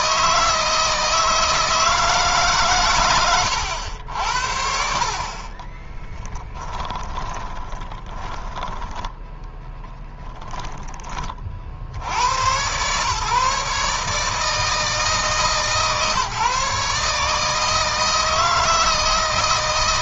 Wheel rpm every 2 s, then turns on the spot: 160, 130, 60, 10, 10, 10, 110, 160, 150, 160.
6-10